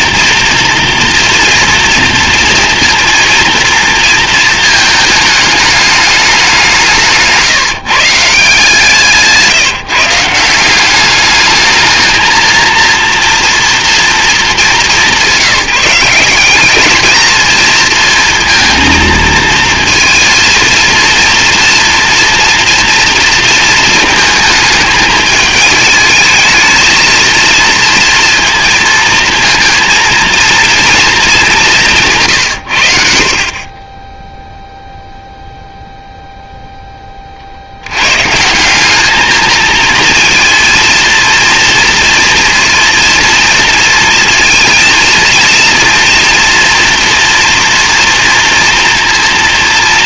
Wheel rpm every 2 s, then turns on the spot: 230, 230, 220, 190, 150, 180, 230, 210, 210, 230, 230, 230, 220, 220, 230, 230, 100, 0, 0, 160, 230, 230, 230, 230, 230.
none